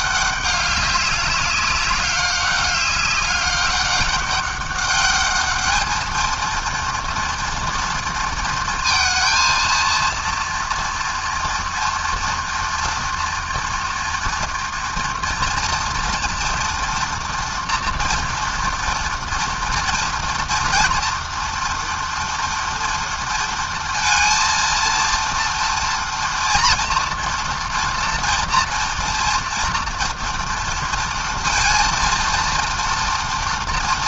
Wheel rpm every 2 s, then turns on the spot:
200, 200, 210, 240, 230, 230, 230, 230, 240, 230, 230, 230, 230, 230, 230, 230, 240.
none